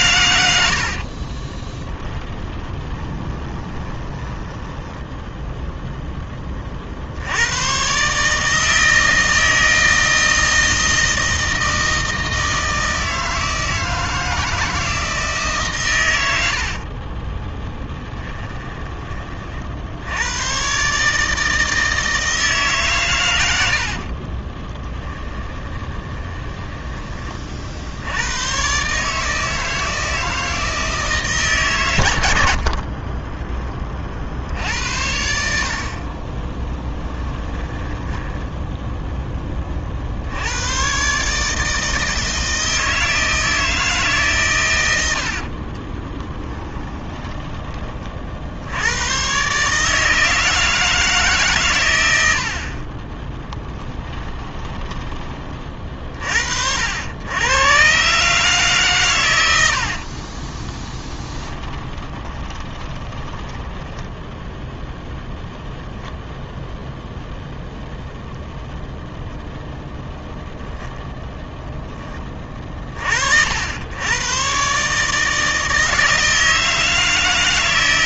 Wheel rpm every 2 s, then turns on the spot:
60, 20, 10, 50, 160, 160, 160, 160, 50, 20, 130, 140, 10, 20, 130, 160, 40, 80, 10, 10, 130, 160, 90, 20, 90, 160, 30, 20, 80, 140, 30, 20, 0, 0, 0, 10, 40, 140, 160.
0-6 16-20 24-26 32-34 36-40 46-48 54-56 60-64